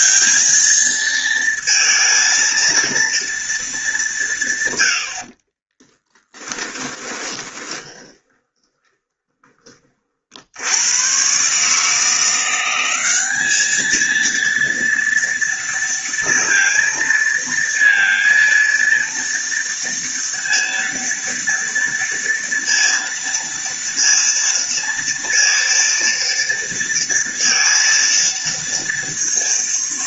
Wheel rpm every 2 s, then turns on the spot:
220, 230, 120, 20, 20, 90, 180, 230, 230, 230, 230, 230, 230, 230, 230.
6-10